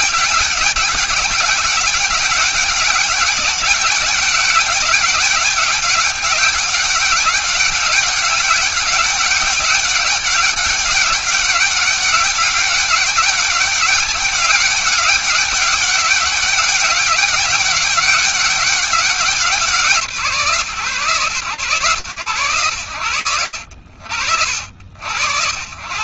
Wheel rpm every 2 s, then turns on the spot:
190, 200, 200, 200, 200, 200, 200, 200, 200, 200, 150, 120, 80.
none